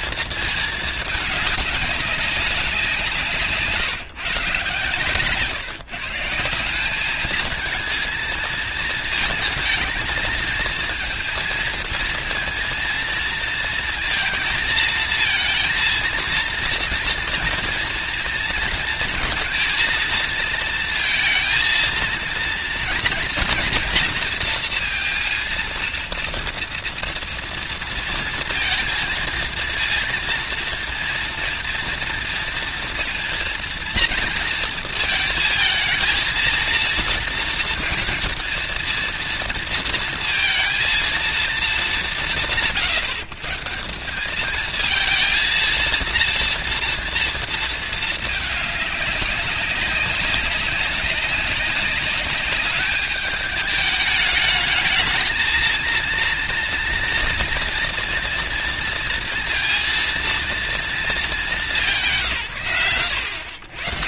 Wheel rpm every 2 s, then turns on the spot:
220, 190, 140, 170, 220, 230, 230, 230, 230, 230, 230, 230, 230, 230, 230, 230, 230, 230, 230, 230, 230, 120, 190, 230, 210, 190, 200, 210, 230, 230, 230, 130.
none